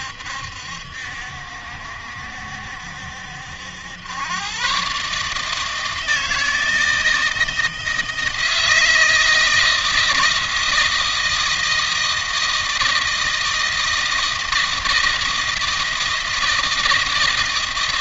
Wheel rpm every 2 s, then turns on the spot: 70, 70, 110, 160, 160, 160, 160, 160, 160.
none